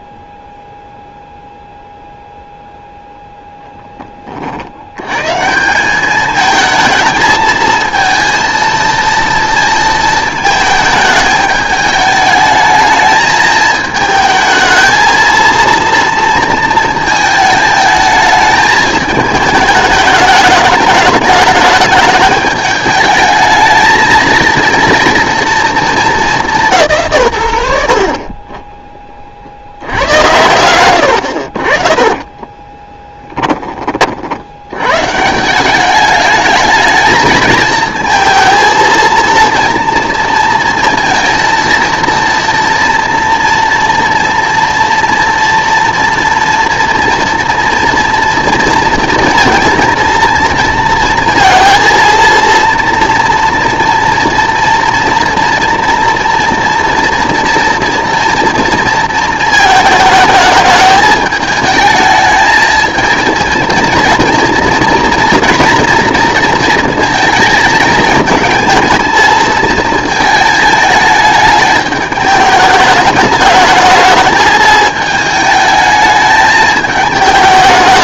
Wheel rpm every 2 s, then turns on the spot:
0, 0, 60, 220, 230, 220, 220, 220, 230, 220, 210, 210, 230, 170, 20, 90, 20, 100, 220, 220, 230, 230, 230, 230, 230, 230, 230, 240, 230, 230, 210, 220, 230, 230, 220, 220, 210, 210, 220.
32-34